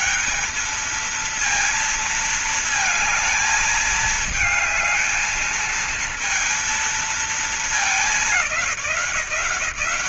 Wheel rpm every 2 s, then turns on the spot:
200, 220, 220, 230, 200.
none